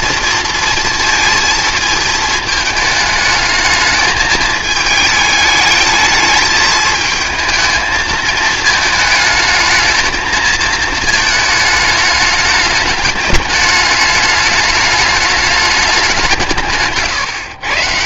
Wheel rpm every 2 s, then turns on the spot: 230, 220, 220, 220, 220, 230, 210, 210, 150.
none